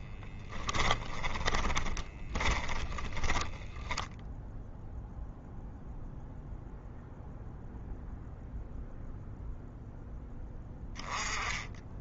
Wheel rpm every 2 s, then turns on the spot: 20, 10, 0, 0, 0, 10.
0-4